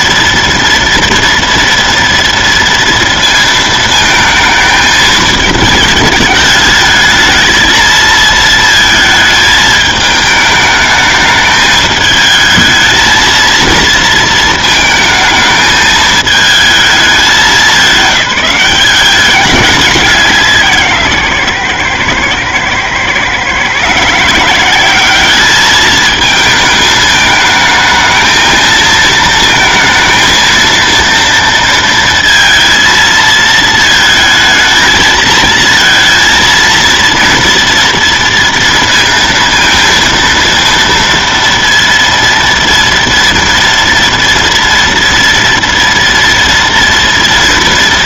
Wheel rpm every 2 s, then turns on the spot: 230, 230, 220, 220, 220, 210, 220, 220, 220, 190, 160, 120, 190, 220, 220, 230, 230, 220, 230, 230, 230, 230, 230, 230.
none